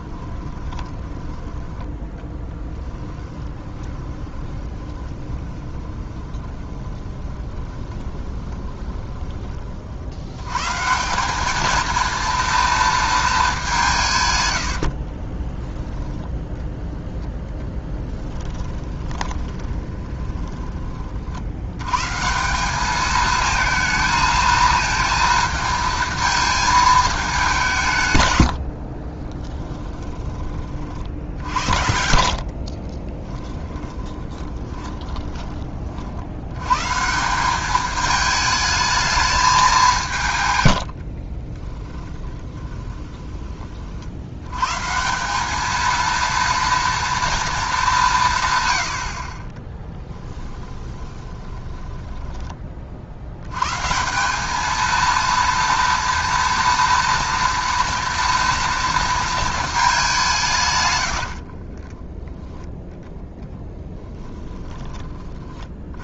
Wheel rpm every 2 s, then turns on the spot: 30, 10, 20, 20, 20, 140, 230, 70, 10, 20, 30, 200, 230, 220, 70, 40, 40, 20, 130, 220, 100, 20, 140, 230, 80, 20, 40, 220, 230, 230, 120, 0, 10.
0-10 14-16 18-20 32-36 40-44 50-52